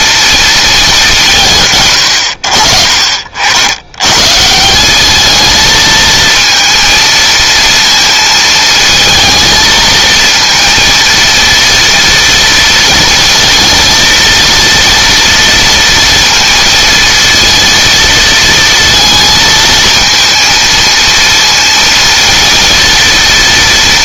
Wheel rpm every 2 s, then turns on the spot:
220, 70, 190, 230, 230, 230, 230, 230, 230, 230, 230, 230.
none